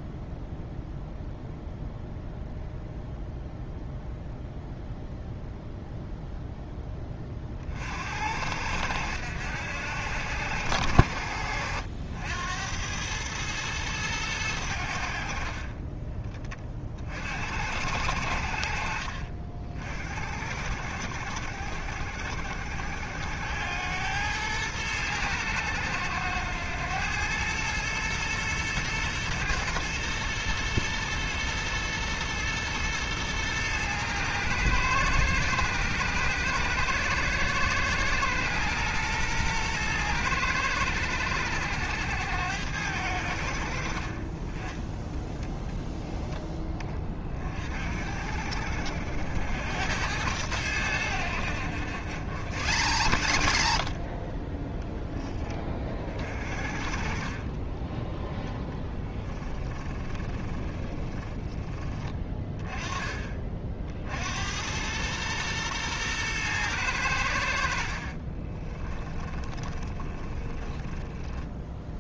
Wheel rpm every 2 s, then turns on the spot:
0, 0, 0, 0, 80, 80, 90, 90, 30, 60, 60, 70, 110, 100, 110, 110, 110, 110, 110, 120, 100, 90, 20, 10, 60, 100, 90, 30, 40, 10, 20, 20, 90, 110, 20, 20.
58-62 68-72